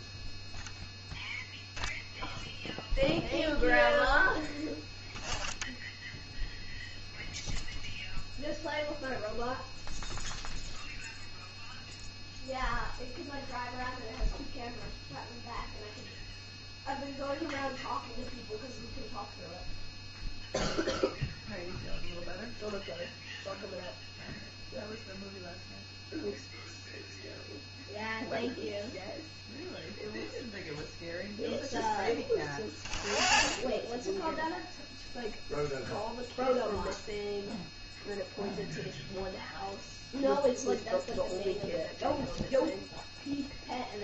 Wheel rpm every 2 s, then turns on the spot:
0, 0, 10, 0, 0, 0, 0, 0, 0, 0, 0, 0, 0, 0, 0, 0, 10, 0, 0, 0, 0, 0.
none